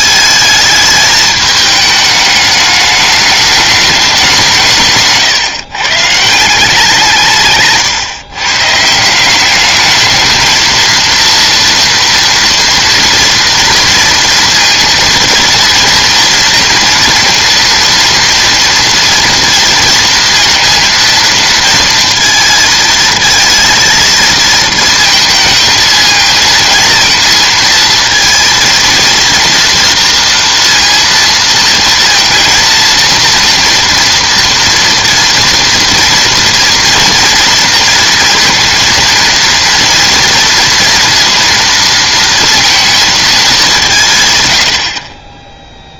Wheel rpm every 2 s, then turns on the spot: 220, 210, 160, 170, 140, 220, 230, 230, 230, 230, 230, 230, 220, 230, 230, 230, 230, 230, 240, 230, 230, 230, 100.
none